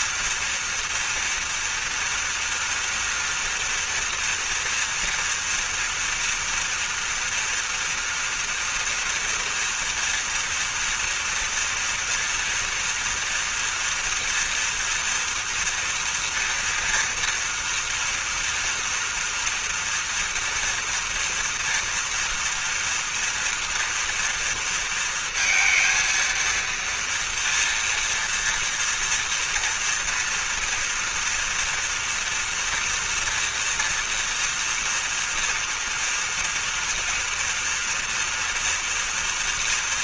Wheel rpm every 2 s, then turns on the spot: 230, 230, 230, 230, 230, 230, 230, 240, 230, 230, 230, 230, 230, 230, 230, 230, 230, 240, 230, 230.
none